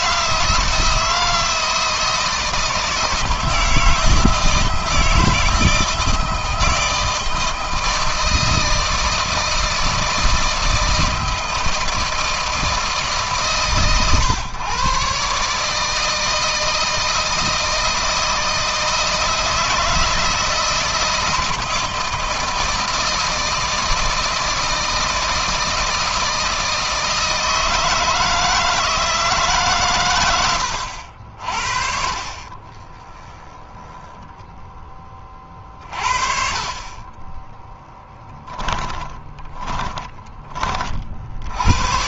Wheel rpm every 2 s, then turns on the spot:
170, 170, 160, 160, 160, 160, 160, 120, 160, 160, 160, 160, 160, 160, 160, 80, 30, 10, 30, 10, 30.
32-34 38-40